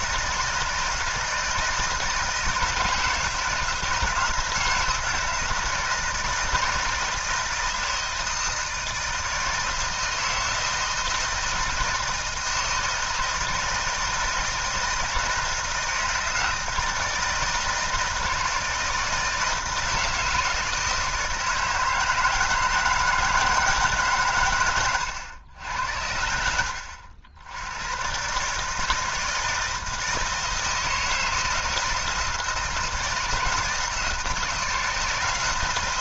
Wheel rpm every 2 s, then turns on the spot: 160, 170, 160, 160, 160, 160, 160, 160, 160, 160, 160, 160, 110, 80, 150, 160, 160, 160.
24-26